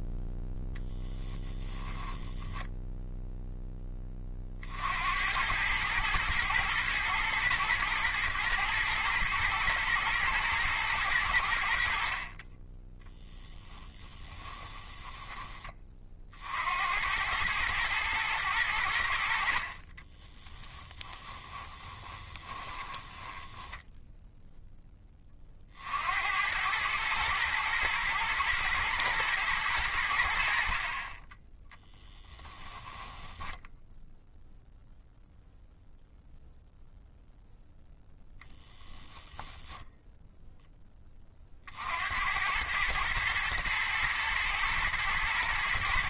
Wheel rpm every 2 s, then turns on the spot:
0, 10, 60, 110, 120, 120, 20, 20, 70, 100, 10, 20, 10, 100, 120, 60, 10, 0, 0, 10, 10, 100, 110.
14-16 20-24 32-34